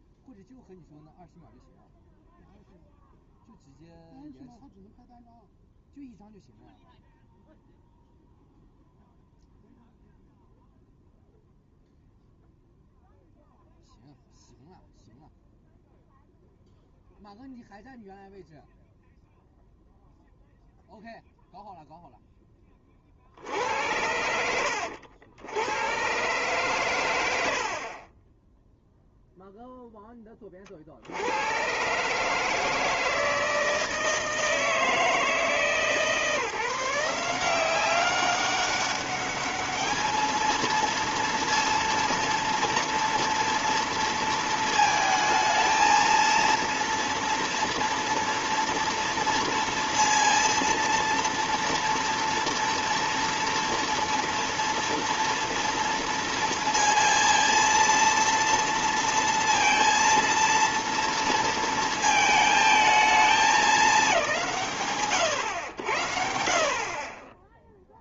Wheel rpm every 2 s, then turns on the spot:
0, 0, 0, 0, 0, 0, 0, 0, 0, 0, 0, 10, 70, 120, 0, 40, 160, 160, 160, 200, 230, 240, 230, 230, 230, 230, 230, 230, 230, 230, 230, 220, 150, 60.
none